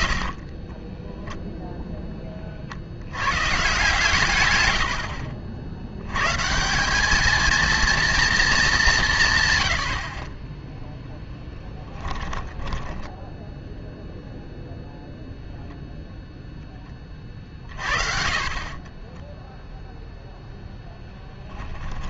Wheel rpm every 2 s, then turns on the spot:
20, 50, 100, 190, 190, 0, 10, 0, 10, 30, 0.
0-2 12-14 18-20